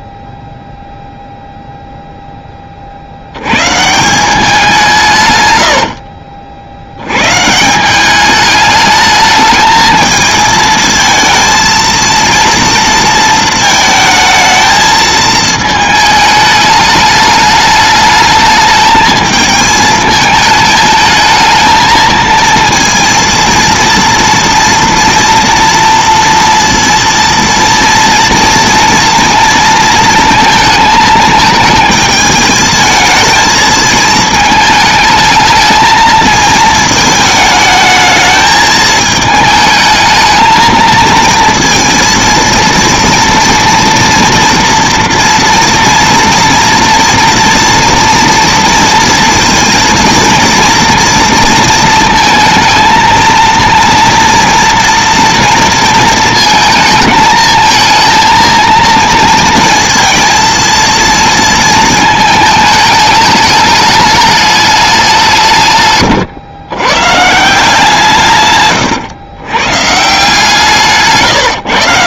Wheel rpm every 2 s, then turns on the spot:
0, 20, 170, 80, 210, 220, 230, 220, 210, 210, 220, 230, 230, 230, 230, 220, 220, 220, 220, 220, 230, 230, 230, 230, 230, 230, 220, 230, 220, 230, 230, 220, 200, 120, 120, 150.
68-70